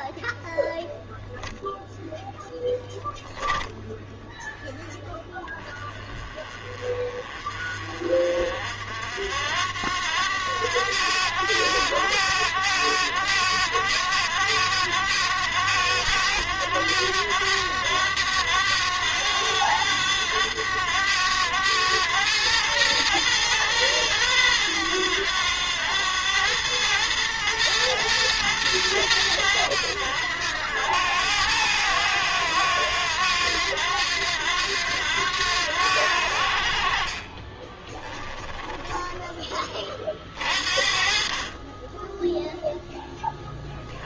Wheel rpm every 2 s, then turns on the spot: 0, 0, 0, 30, 50, 90, 100, 100, 100, 100, 100, 110, 110, 100, 110, 90, 90, 90, 70, 20, 40, 10.
38-40